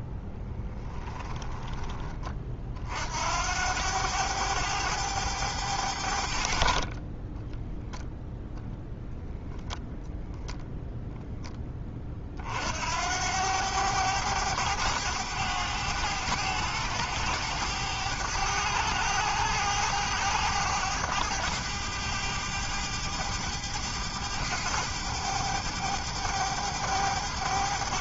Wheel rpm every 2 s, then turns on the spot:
10, 50, 100, 40, 0, 0, 70, 100, 100, 100, 100, 100, 100, 100.
0-2